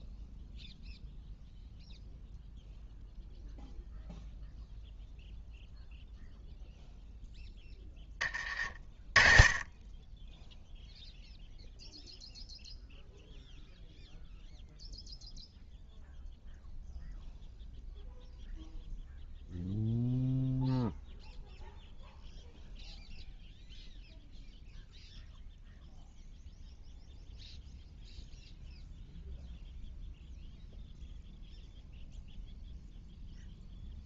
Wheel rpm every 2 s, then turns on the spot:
0, 0, 0, 0, 30, 0, 0, 0, 0, 0, 0, 0, 0, 0, 0, 0, 0.
none